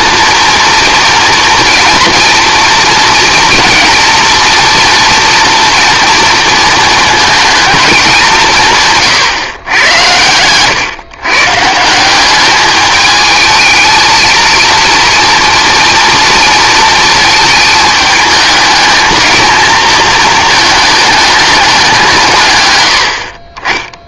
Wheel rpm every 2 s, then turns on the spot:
240, 230, 240, 230, 150, 120, 200, 230, 220, 220, 220, 120.
none